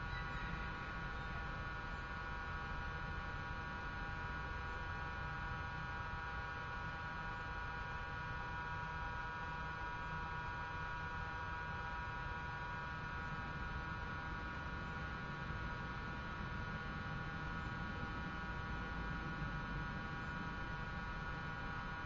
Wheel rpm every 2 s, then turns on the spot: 0, 0, 0, 0, 0, 0, 0, 0, 0, 0, 0.
none